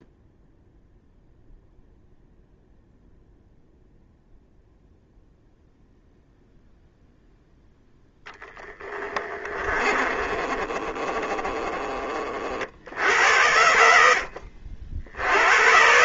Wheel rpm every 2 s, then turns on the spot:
0, 0, 0, 0, 30, 30, 60, 60.
8-12